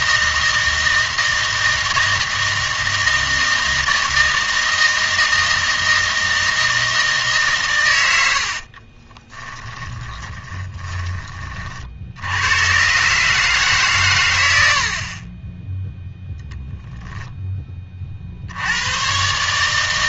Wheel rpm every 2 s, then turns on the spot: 160, 160, 160, 160, 50, 10, 120, 80, 0, 90.
8-12